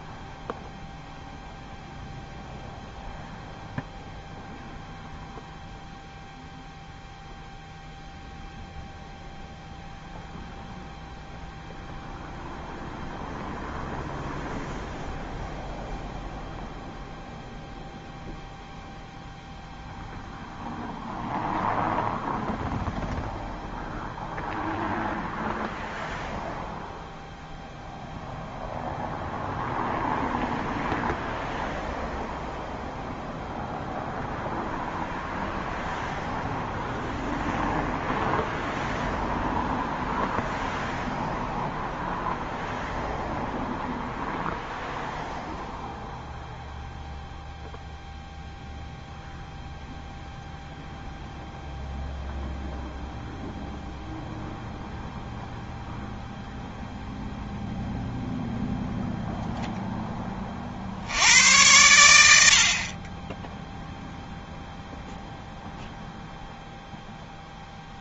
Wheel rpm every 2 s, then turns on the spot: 0, 0, 0, 0, 0, 0, 0, 0, 0, 0, 0, 0, 0, 0, 0, 0, 0, 0, 0, 0, 0, 0, 0, 0, 0, 0, 0, 0, 0, 0, 50, 60, 0, 0.
none